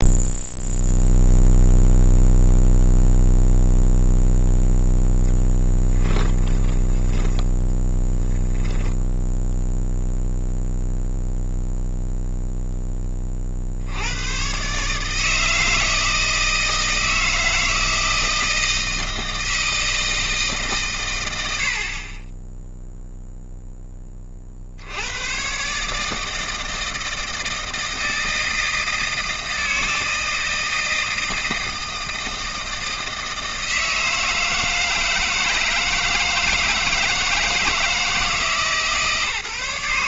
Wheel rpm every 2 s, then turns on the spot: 0, 0, 0, 10, 0, 0, 0, 120, 160, 160, 150, 10, 50, 160, 160, 160, 160, 160, 160, 160.
6-8